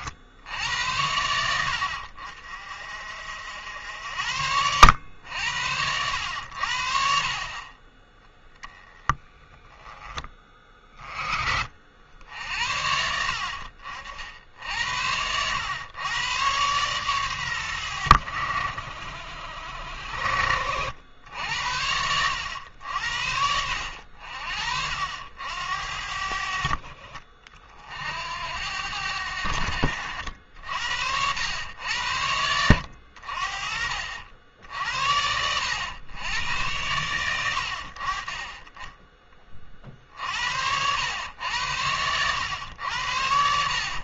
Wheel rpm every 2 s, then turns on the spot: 90, 50, 90, 70, 10, 30, 70, 70, 120, 60, 80, 80, 60, 50, 80, 70, 80, 70, 100, 10, 80, 90.
none